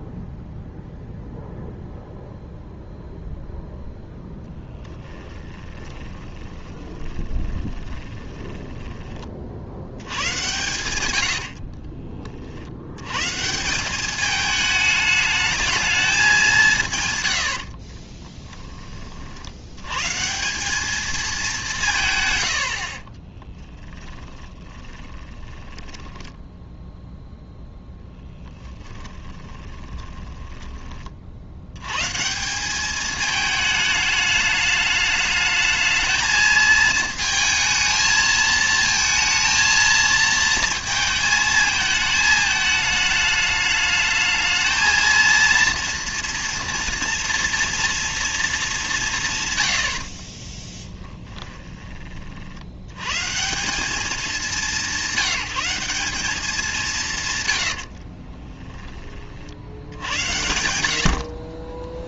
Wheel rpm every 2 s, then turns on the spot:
0, 0, 20, 20, 10, 100, 80, 210, 160, 20, 170, 80, 30, 10, 10, 20, 190, 210, 220, 220, 230, 210, 220, 230, 210, 20, 90, 200, 180, 20, 70.
4-10 24-32 50-52 58-60